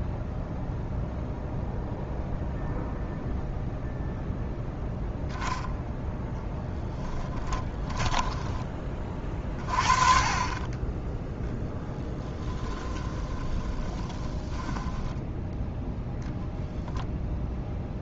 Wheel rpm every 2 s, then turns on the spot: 0, 0, 10, 10, 20, 20, 10, 10, 0.
12-16